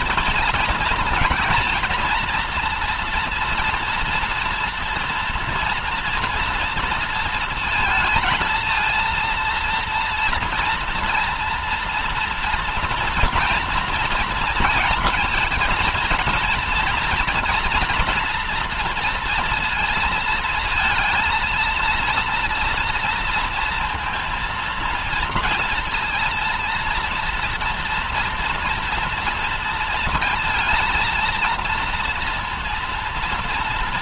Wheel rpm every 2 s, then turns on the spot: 230, 230, 230, 230, 230, 230, 240, 240, 230, 240, 230, 230, 230, 230, 230, 230, 230.
none